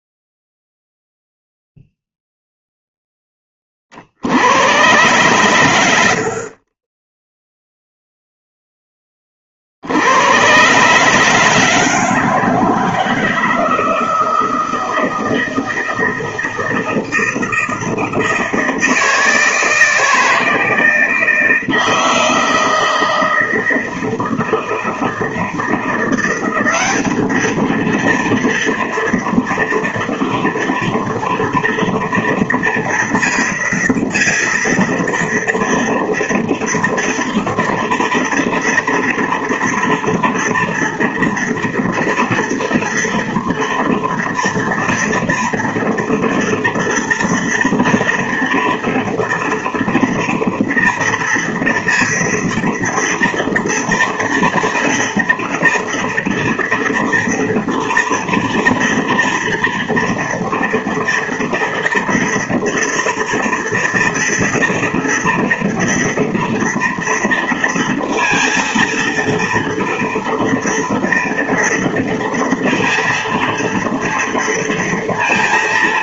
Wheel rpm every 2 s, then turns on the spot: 0, 0, 100, 30, 10, 130, 160, 160, 160, 160, 160, 170, 160, 190, 230, 240, 230, 230, 230, 230, 230, 230, 230, 230, 230, 230, 230, 230, 230, 230, 230, 230, 230, 230, 230, 230, 230, 230.
none